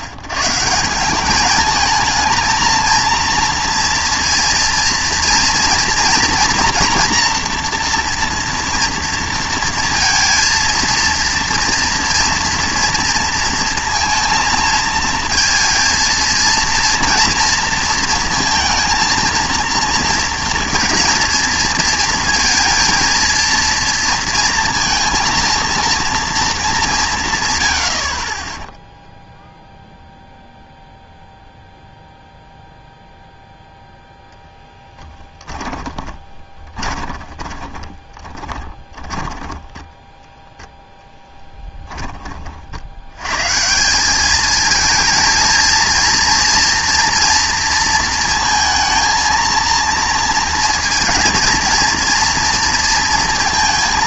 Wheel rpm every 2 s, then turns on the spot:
130, 220, 230, 240, 230, 230, 240, 230, 230, 230, 230, 230, 230, 220, 10, 0, 0, 10, 20, 20, 0, 50, 220, 230, 230, 230, 240.
36-40